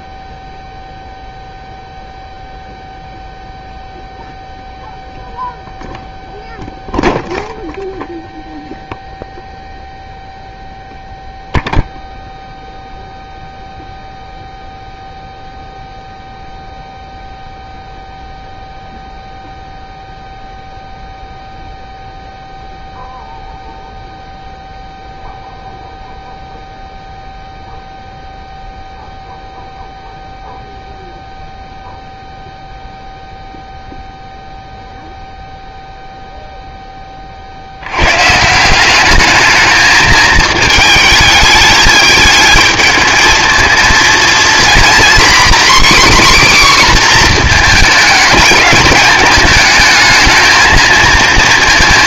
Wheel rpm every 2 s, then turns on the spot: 0, 0, 0, 0, 0, 0, 0, 0, 0, 0, 0, 0, 0, 0, 0, 0, 0, 0, 0, 170, 220, 220, 240, 270, 220, 220.
none